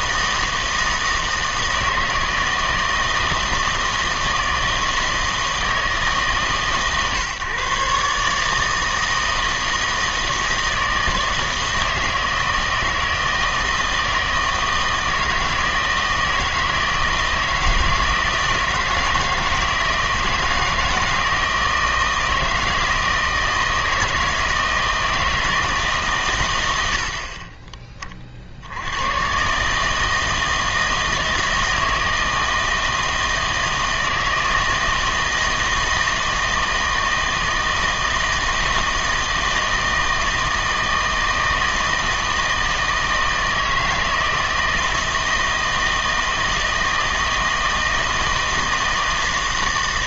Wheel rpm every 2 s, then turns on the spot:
160, 160, 160, 150, 150, 160, 160, 160, 160, 160, 160, 160, 160, 120, 70, 160, 160, 160, 160, 160, 160, 160, 160, 160, 160.
none